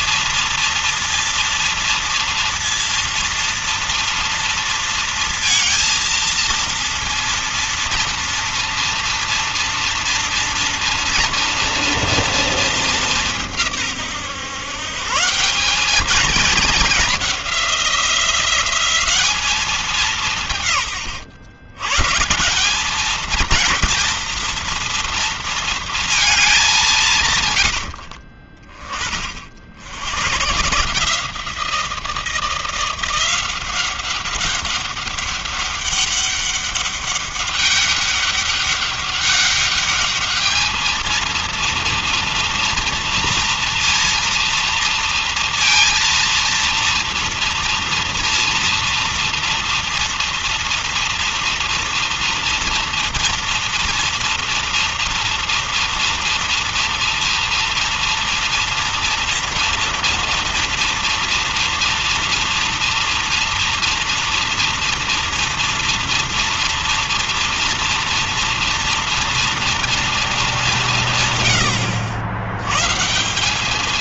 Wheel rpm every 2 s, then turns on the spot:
230, 230, 230, 230, 230, 230, 230, 130, 210, 190, 170, 150, 230, 210, 40, 120, 170, 190, 200, 200, 210, 230, 230, 230, 230, 240, 230, 230, 230, 230, 230, 230, 230, 230, 230, 220, 110.
none